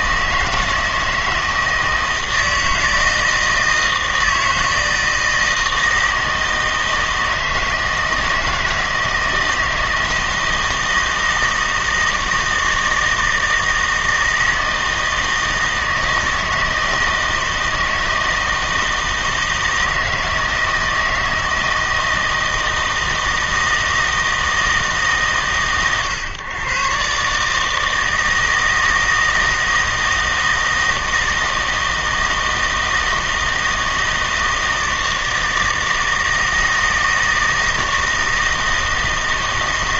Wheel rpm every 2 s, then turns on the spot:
160, 160, 160, 160, 160, 160, 160, 160, 160, 160, 160, 160, 160, 120, 160, 160, 160, 160, 160, 160.
none